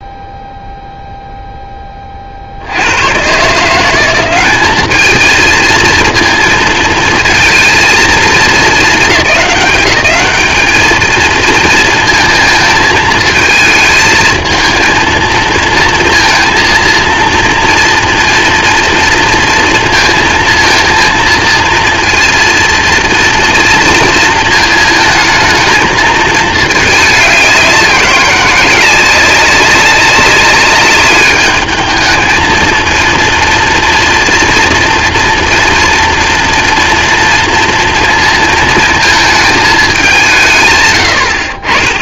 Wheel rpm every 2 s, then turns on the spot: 0, 100, 220, 230, 210, 230, 220, 230, 230, 230, 230, 230, 220, 200, 190, 200, 230, 230, 230, 220, 90.
none